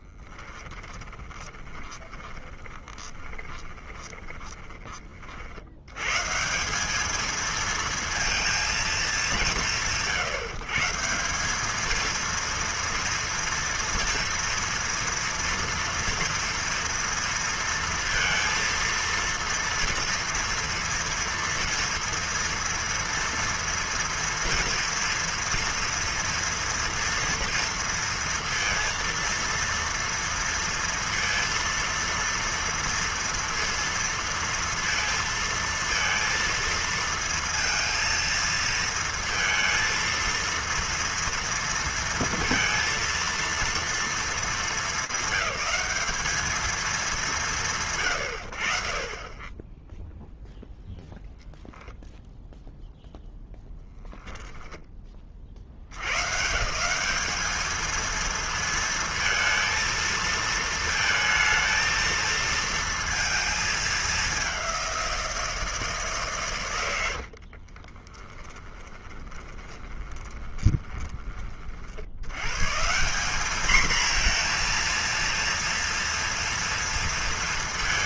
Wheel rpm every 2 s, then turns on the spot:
10, 20, 20, 150, 230, 140, 230, 230, 230, 230, 230, 230, 230, 230, 230, 230, 230, 230, 230, 230, 230, 230, 220, 200, 50, 0, 0, 20, 180, 230, 220, 230, 190, 100, 20, 20, 170, 230, 220.
0-6 68-72